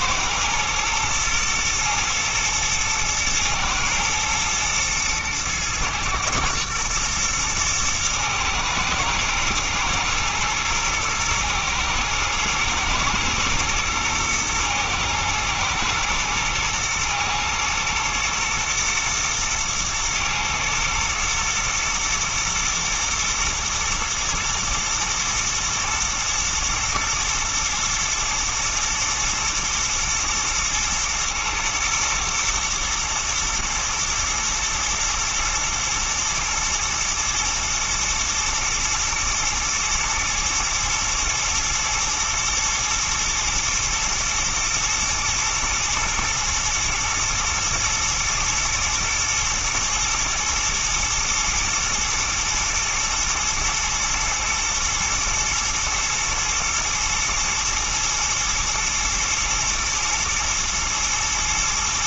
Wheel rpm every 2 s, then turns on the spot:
120, 110, 120, 110, 110, 120, 110, 120, 120, 120, 110, 120, 110, 110, 120, 110, 110, 110, 120, 110, 110, 110, 110, 110, 110, 110, 110, 120, 110, 110, 120.
none